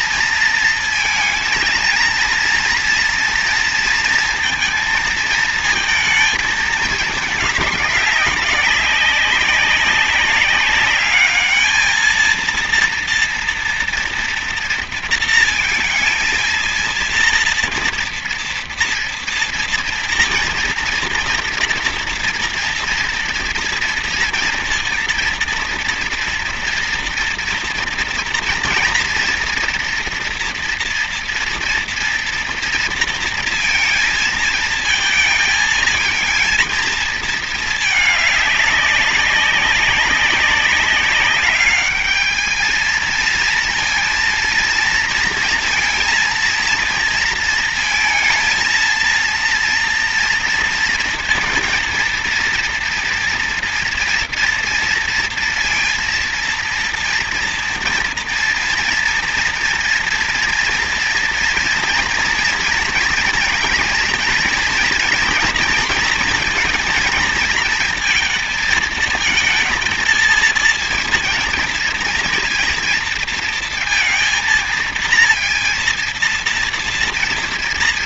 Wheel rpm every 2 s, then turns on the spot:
230, 230, 230, 220, 200, 200, 230, 230, 230, 230, 230, 230, 230, 240, 230, 230, 230, 220, 220, 200, 200, 220, 230, 230, 230, 230, 230, 230, 230, 230, 240, 240, 230, 230, 230, 230, 230, 230, 230.
none